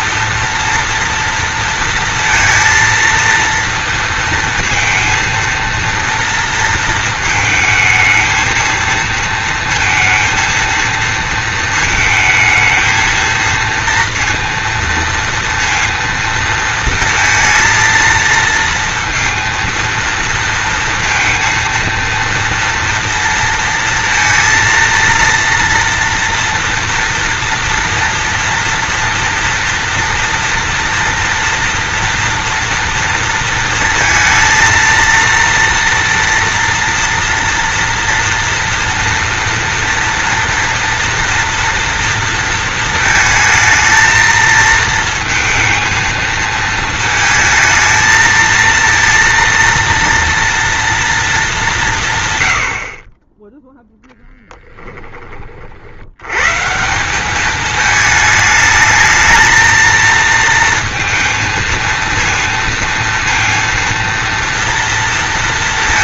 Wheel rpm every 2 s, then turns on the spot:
230, 230, 230, 230, 220, 230, 220, 230, 230, 230, 230, 230, 230, 230, 230, 230, 230, 230, 230, 230, 240, 230, 230, 220, 230, 230, 80, 10, 160, 220, 230, 230, 230.
54-56